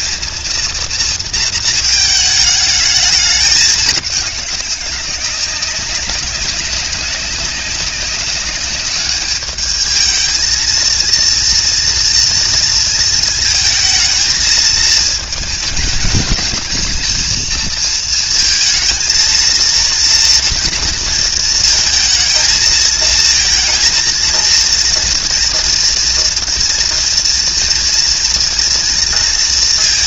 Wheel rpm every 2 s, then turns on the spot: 230, 210, 190, 190, 200, 220, 220, 220, 220, 230, 230, 220, 230, 230, 240.
none